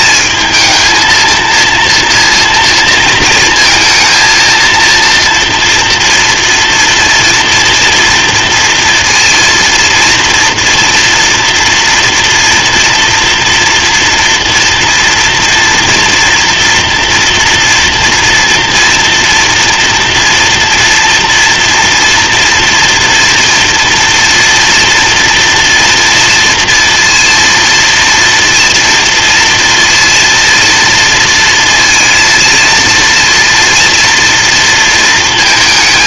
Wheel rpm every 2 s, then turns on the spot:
230, 230, 230, 230, 230, 230, 240, 230, 230, 230, 230, 230, 240, 230, 240, 230, 230, 230.
none